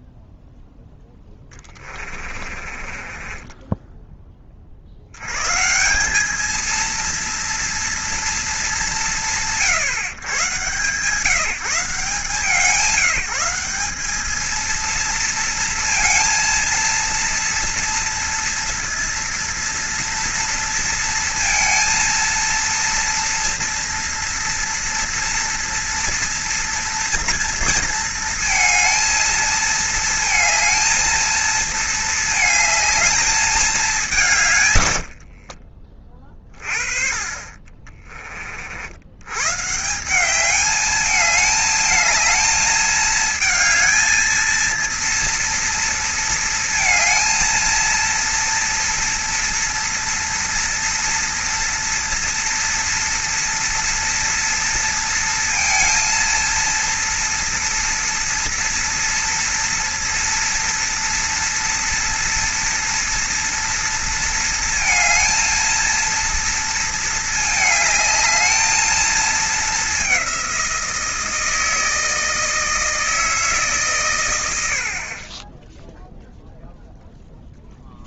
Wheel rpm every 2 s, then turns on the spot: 0, 30, 40, 220, 170, 140, 170, 230, 230, 230, 230, 230, 230, 230, 230, 230, 220, 130, 30, 60, 210, 220, 230, 230, 230, 230, 230, 230, 230, 230, 240, 240, 230, 230, 220, 190, 160, 90, 0.
2-4